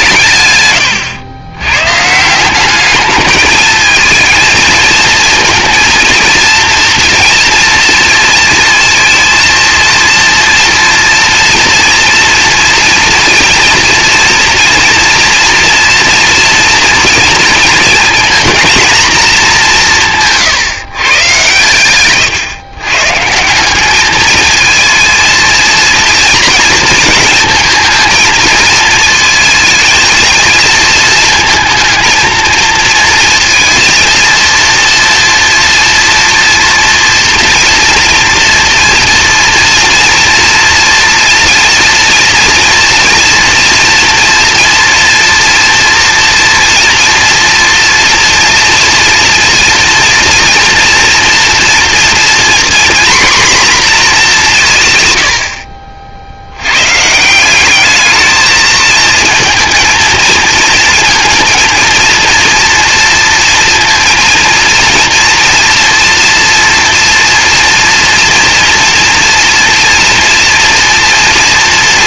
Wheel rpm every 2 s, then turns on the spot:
100, 200, 220, 230, 230, 230, 230, 230, 230, 230, 150, 130, 220, 230, 220, 230, 220, 230, 230, 230, 230, 230, 240, 230, 230, 240, 240, 170, 90, 220, 230, 230, 230, 230, 230, 230.
none